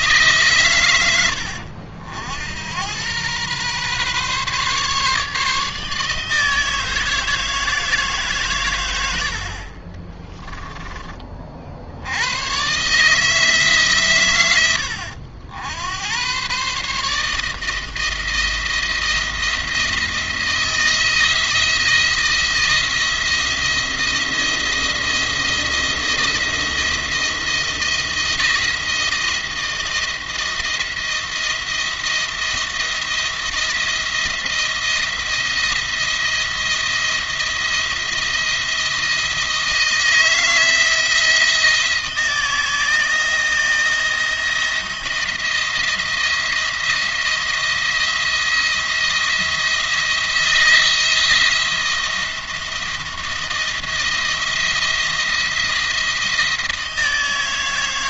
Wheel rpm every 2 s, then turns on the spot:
120, 100, 140, 160, 110, 20, 130, 90, 140, 170, 170, 170, 170, 170, 160, 170, 170, 170, 170, 170, 160, 160, 170, 170, 170, 170, 170, 170, 160.
none